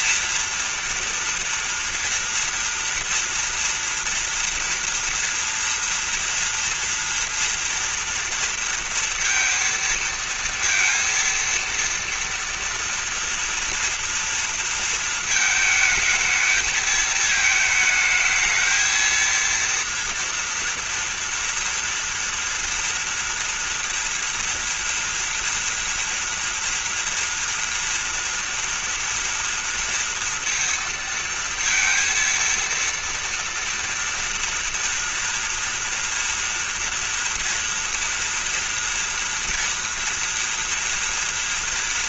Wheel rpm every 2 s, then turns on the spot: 230, 230, 230, 230, 230, 230, 240, 230, 220, 220, 230, 230, 230, 230, 230, 230, 230, 230, 230, 240, 230.
none